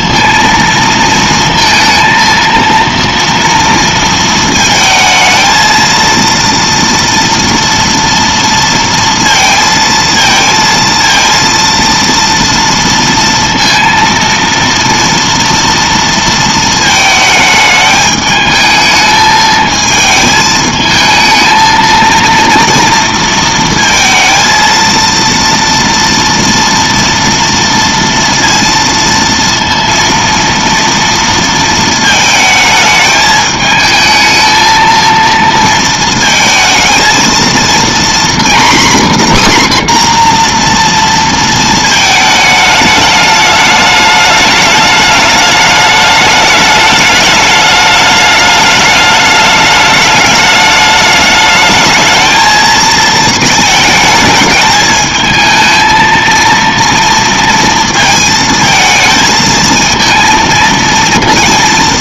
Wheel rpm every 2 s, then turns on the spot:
230, 230, 230, 230, 230, 230, 230, 230, 220, 220, 220, 230, 230, 230, 230, 230, 220, 220, 220, 260, 240, 210, 210, 210, 210, 210, 220, 210, 230, 220, 230.
none